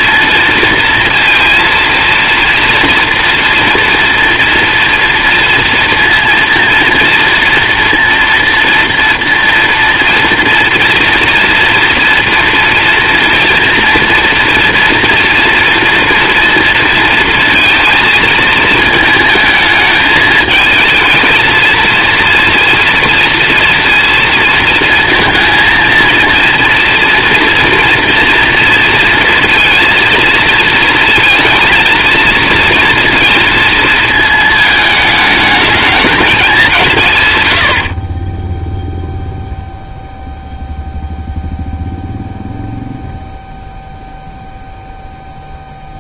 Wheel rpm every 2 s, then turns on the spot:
230, 230, 230, 230, 230, 240, 230, 230, 230, 220, 220, 230, 230, 240, 240, 230, 230, 220, 160, 0, 0, 0, 0.
none